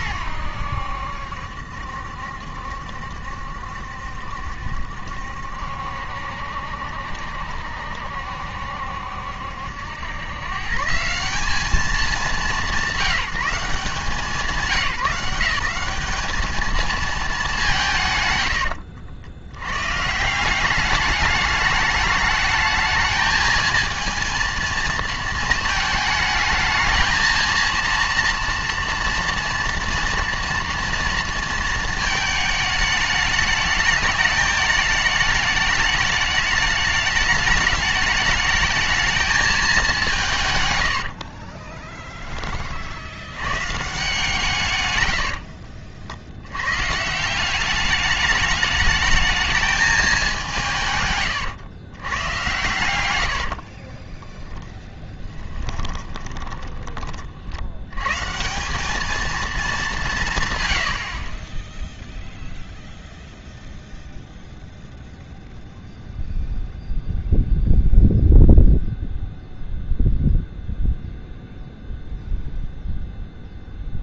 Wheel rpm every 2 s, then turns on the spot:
90, 70, 70, 70, 70, 150, 190, 170, 220, 100, 190, 220, 230, 220, 230, 230, 210, 210, 210, 220, 110, 40, 130, 110, 210, 160, 110, 10, 30, 170, 120, 0, 0, 0, 0, 0, 0.
18-20 54-58